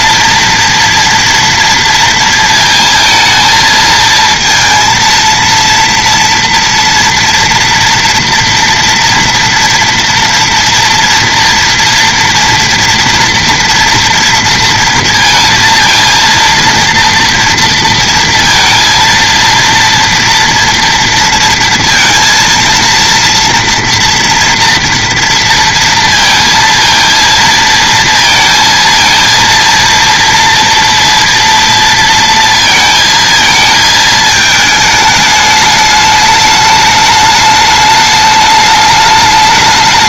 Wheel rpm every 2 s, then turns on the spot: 230, 230, 230, 230, 230, 230, 230, 230, 230, 230, 230, 230, 230, 230, 230, 230, 230, 220, 210, 210.
none